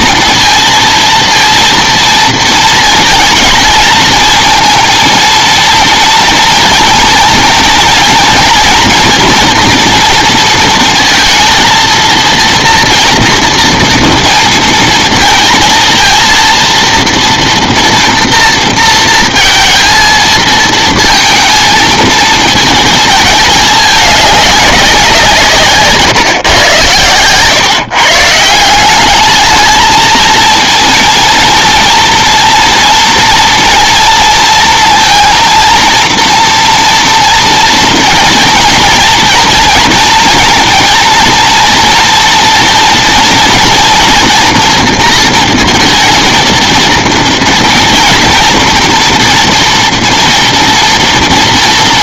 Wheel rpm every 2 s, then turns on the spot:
230, 230, 230, 230, 230, 220, 230, 220, 230, 230, 220, 220, 190, 120, 180, 230, 230, 230, 230, 230, 230, 230, 230, 230, 230, 240.
none